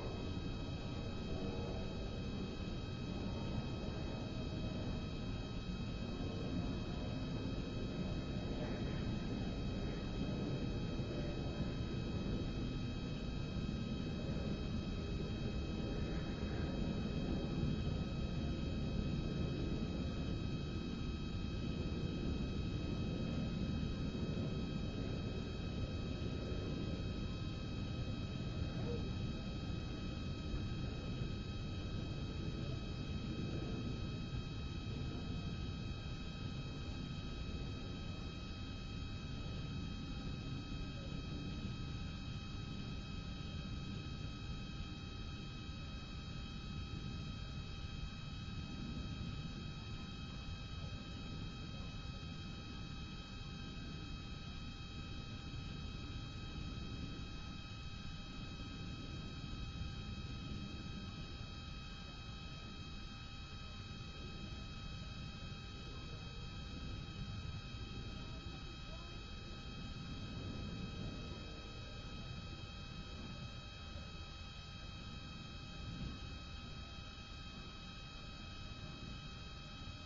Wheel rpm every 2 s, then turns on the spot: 0, 0, 0, 0, 0, 0, 0, 0, 0, 0, 0, 0, 0, 0, 0, 0, 0, 0, 0, 0, 0, 0, 0, 0, 0, 0, 0, 0, 0, 0, 0, 0, 0, 0, 0, 0, 0, 0, 0, 0.
none